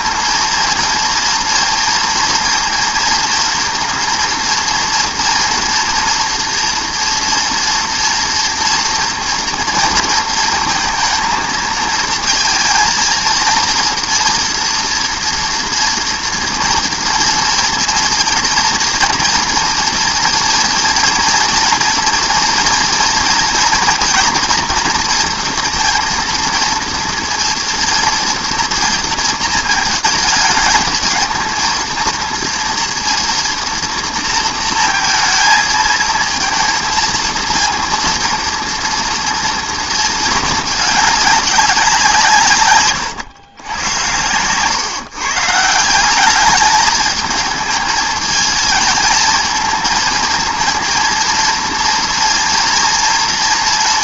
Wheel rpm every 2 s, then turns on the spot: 230, 230, 230, 230, 230, 230, 220, 240, 230, 230, 230, 230, 230, 230, 230, 220, 230, 230, 230, 240, 220, 140, 130, 210, 220, 230, 230.
none